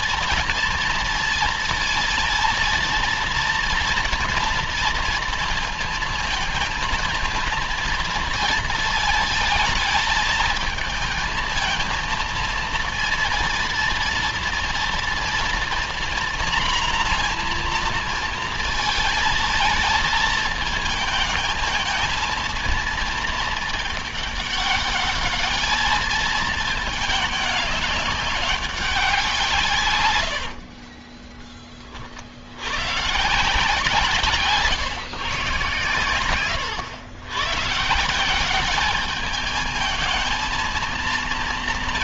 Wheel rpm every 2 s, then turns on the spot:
230, 230, 230, 230, 220, 230, 230, 240, 240, 220, 220, 220, 210, 210, 180, 30, 140, 150, 110, 210, 230.
30-32